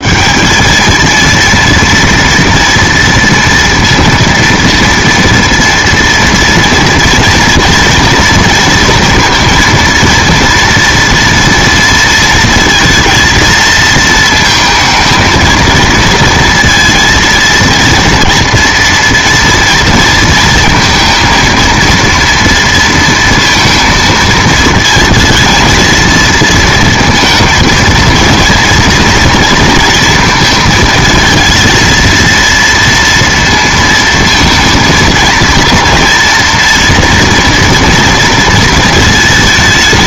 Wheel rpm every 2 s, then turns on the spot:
200, 230, 230, 230, 230, 230, 230, 220, 230, 240, 230, 230, 220, 230, 230, 220, 230, 230, 240, 230.
none